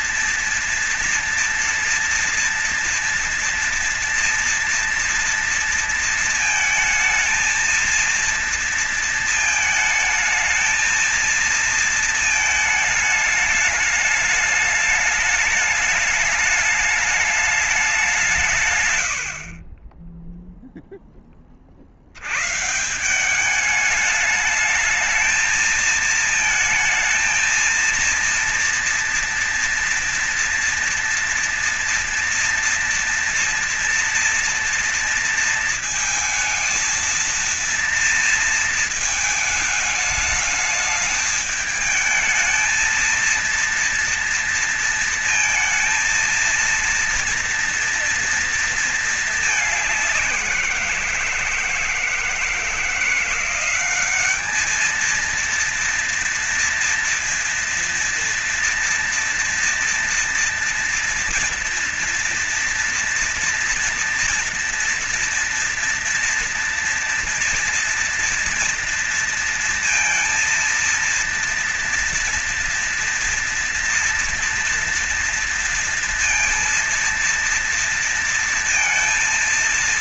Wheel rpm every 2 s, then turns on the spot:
230, 240, 240, 230, 230, 220, 210, 210, 210, 130, 0, 140, 220, 220, 230, 230, 230, 230, 220, 220, 210, 220, 230, 230, 220, 180, 170, 220, 230, 240, 240, 240, 230, 230, 230, 230, 230, 240, 230, 230.
none